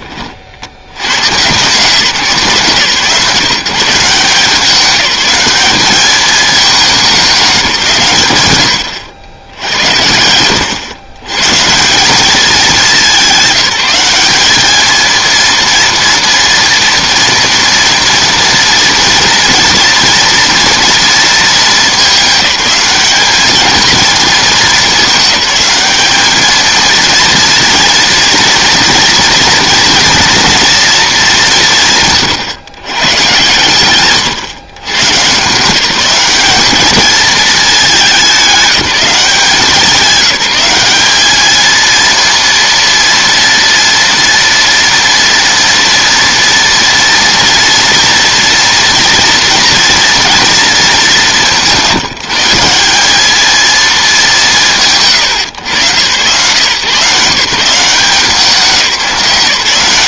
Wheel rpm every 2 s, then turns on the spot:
70, 150, 180, 200, 110, 120, 200, 210, 230, 230, 230, 210, 210, 220, 240, 230, 130, 130, 210, 200, 200, 230, 230, 230, 230, 230, 180, 170, 130, 180.
none